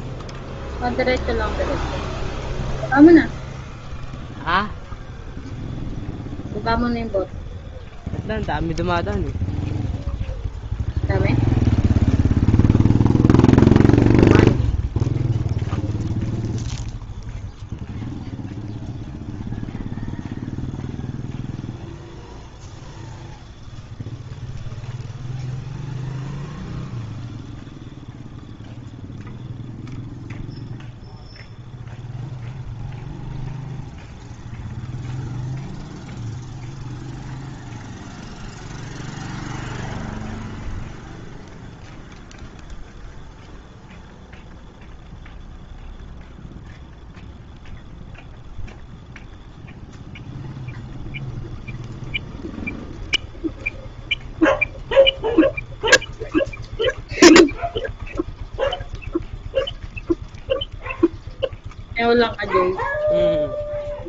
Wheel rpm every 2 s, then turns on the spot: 0, 0, 0, 0, 0, 0, 0, 0, 0, 0, 0, 0, 0, 0, 0, 0, 0, 0, 0, 0, 0, 0, 0, 0, 0, 0, 0, 0, 0, 0, 0, 0.
none